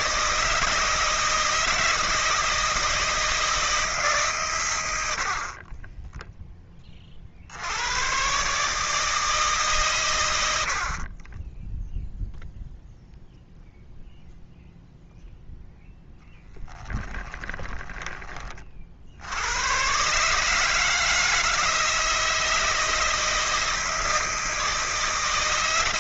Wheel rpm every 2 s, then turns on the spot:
160, 160, 110, 10, 140, 70, 0, 0, 10, 30, 150, 160, 160.
16-18